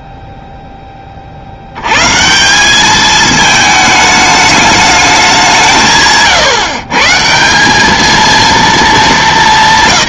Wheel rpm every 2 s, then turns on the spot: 60, 220, 190, 170, 210.
none